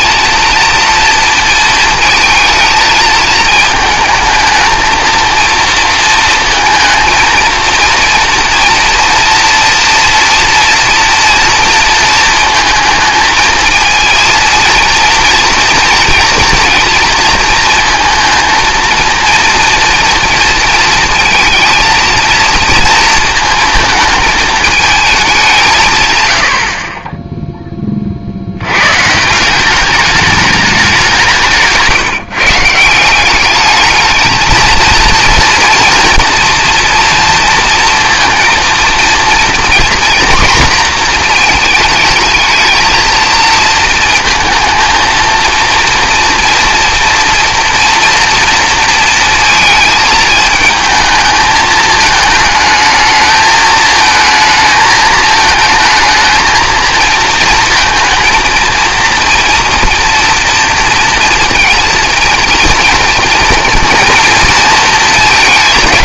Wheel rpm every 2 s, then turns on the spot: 230, 220, 220, 230, 230, 230, 220, 230, 230, 230, 230, 230, 220, 80, 100, 200, 150, 220, 230, 230, 240, 220, 230, 230, 230, 220, 220, 220, 230, 230, 230, 230, 230.
none